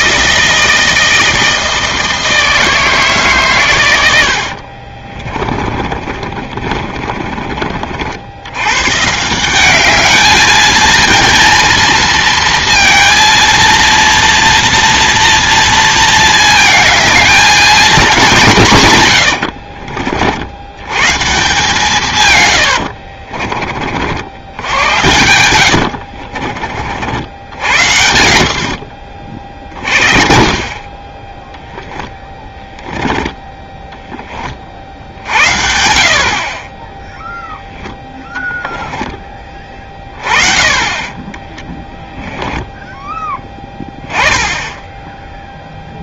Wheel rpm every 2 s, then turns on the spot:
160, 160, 50, 30, 100, 220, 230, 230, 220, 150, 90, 100, 80, 40, 60, 30, 10, 40, 20, 10, 30, 10, 10.
4-8 22-24 38-40